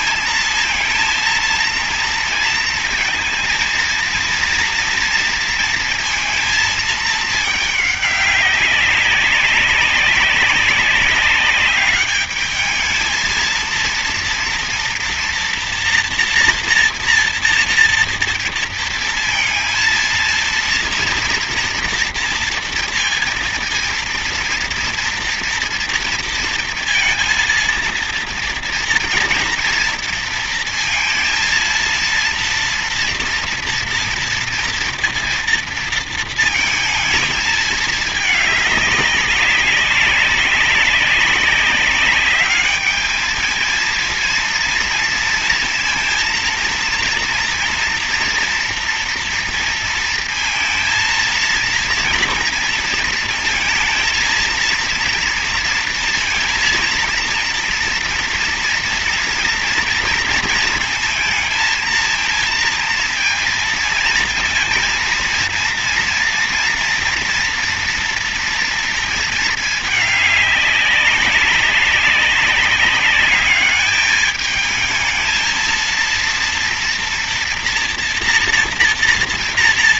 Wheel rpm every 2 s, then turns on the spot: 220, 230, 230, 220, 190, 190, 210, 230, 240, 230, 230, 230, 230, 230, 230, 230, 230, 230, 230, 210, 190, 210, 230, 230, 230, 230, 230, 230, 230, 230, 230, 230, 230, 230, 230, 200, 200, 220, 240, 230.
none